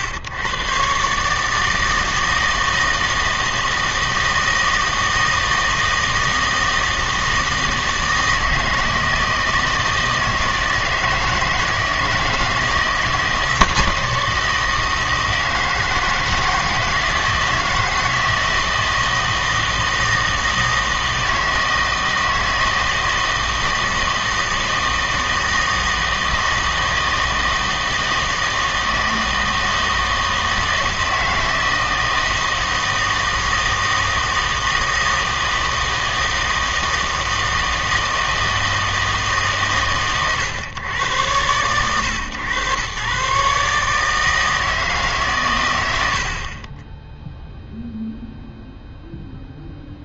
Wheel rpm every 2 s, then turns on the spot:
110, 160, 160, 160, 160, 160, 160, 160, 160, 160, 160, 160, 160, 160, 160, 160, 160, 160, 160, 160, 120, 120, 160, 30, 0.
none